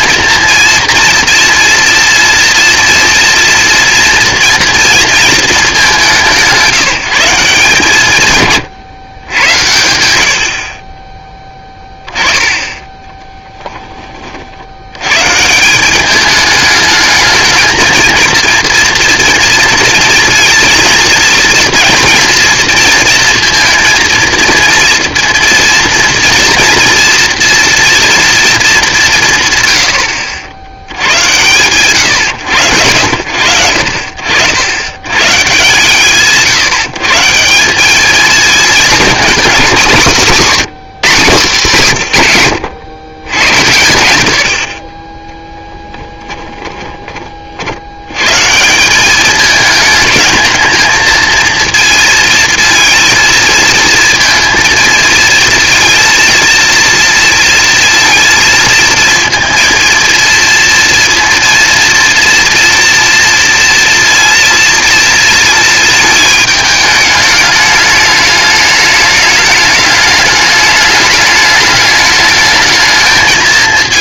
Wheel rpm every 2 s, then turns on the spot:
230, 230, 230, 180, 130, 70, 10, 70, 210, 230, 230, 230, 230, 230, 220, 80, 80, 90, 150, 220, 220, 130, 60, 10, 160, 220, 230, 230, 230, 230, 230, 230, 230, 220, 210, 210, 210.
46-48